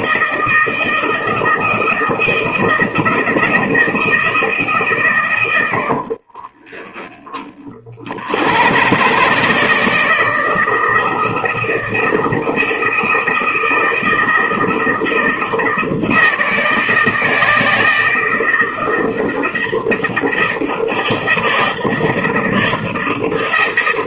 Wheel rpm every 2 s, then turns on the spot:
160, 160, 150, 10, 90, 160, 160, 160, 160, 160, 160, 160.
6-8